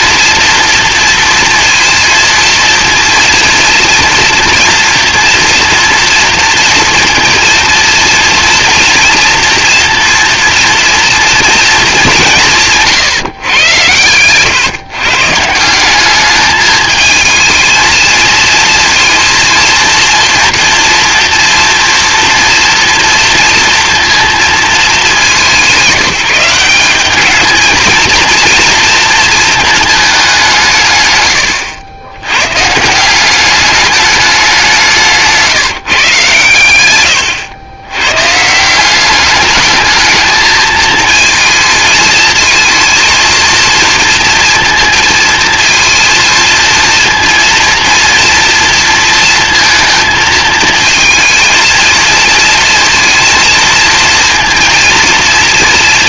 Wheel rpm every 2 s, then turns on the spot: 230, 230, 230, 230, 230, 230, 160, 130, 210, 230, 230, 230, 210, 180, 230, 160, 140, 200, 130, 160, 220, 230, 230, 230, 230, 230, 230, 230.
12-14